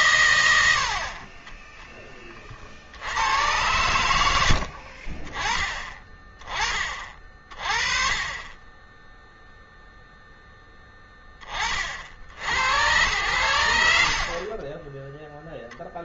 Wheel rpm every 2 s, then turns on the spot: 80, 40, 70, 20, 20, 10, 90, 40.
14-16